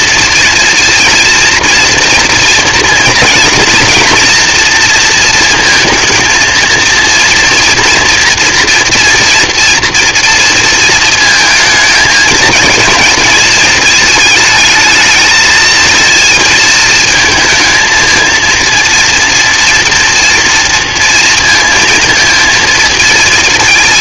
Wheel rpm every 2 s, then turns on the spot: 230, 230, 240, 230, 240, 230, 220, 220, 220, 230, 230, 220.
none